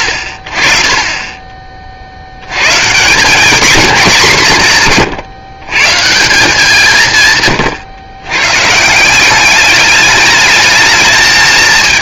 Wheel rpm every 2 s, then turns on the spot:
50, 130, 180, 160, 140, 220.
none